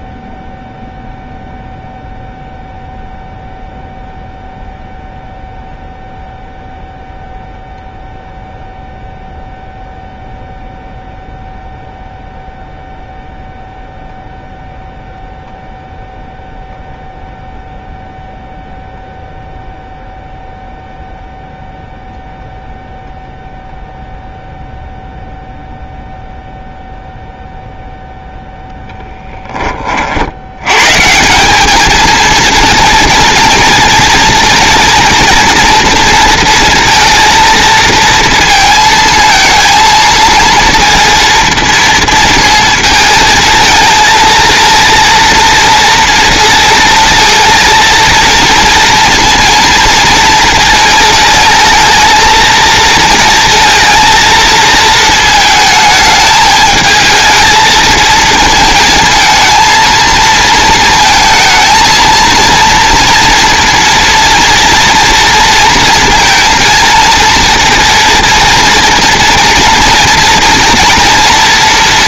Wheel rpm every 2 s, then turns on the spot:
0, 0, 0, 0, 0, 0, 0, 0, 0, 0, 0, 0, 0, 0, 0, 130, 230, 230, 230, 230, 230, 220, 230, 230, 240, 230, 220, 220, 220, 230, 230, 230, 230, 230, 230, 230.
none